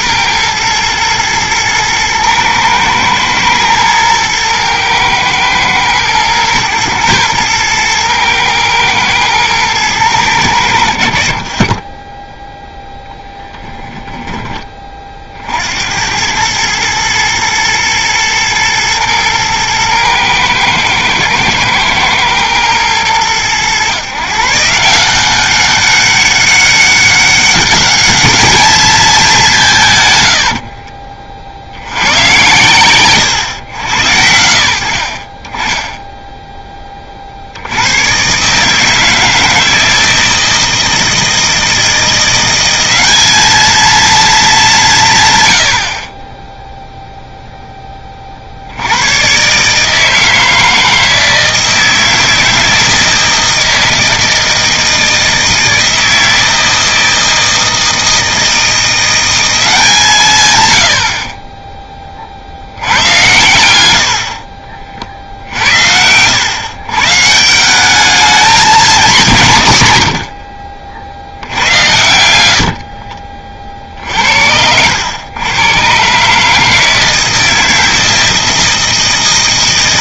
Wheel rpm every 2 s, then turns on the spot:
110, 110, 110, 110, 110, 90, 0, 30, 110, 110, 110, 110, 160, 200, 210, 70, 120, 70, 10, 150, 160, 190, 200, 0, 80, 160, 160, 160, 160, 170, 110, 70, 40, 120, 230, 50, 70, 80, 160, 160.
30-32 72-74